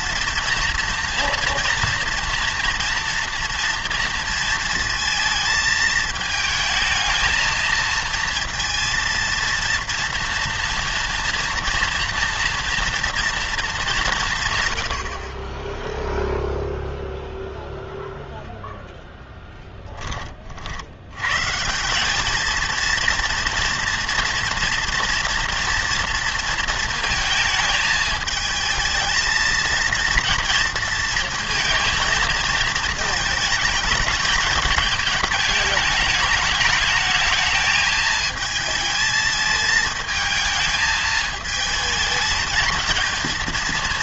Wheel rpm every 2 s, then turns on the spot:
230, 240, 230, 220, 230, 230, 230, 120, 0, 0, 60, 220, 230, 230, 220, 230, 220, 210, 210, 220, 220, 220.
none